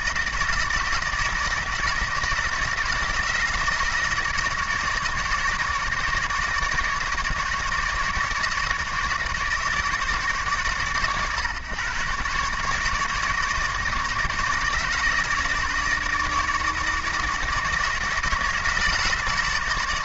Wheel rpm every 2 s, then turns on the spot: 160, 160, 160, 150, 150, 130, 150, 150, 160, 160.
none